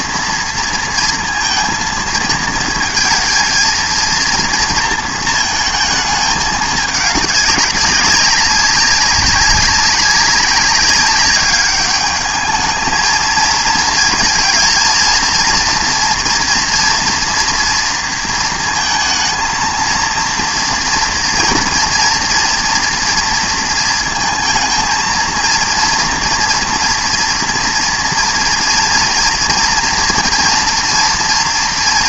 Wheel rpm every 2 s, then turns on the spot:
230, 220, 230, 210, 200, 200, 220, 220, 230, 230, 230, 240, 220, 240, 230, 230.
none